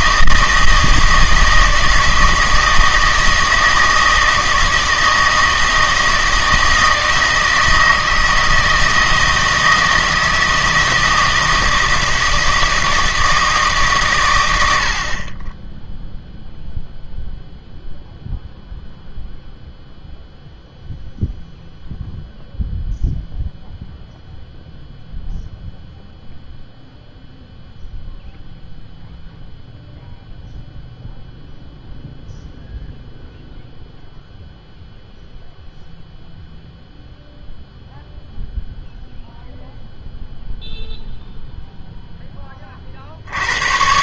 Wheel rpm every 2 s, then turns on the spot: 160, 160, 160, 160, 160, 160, 160, 100, 0, 0, 0, 0, 0, 0, 0, 0, 0, 0, 0, 0, 0, 30.
none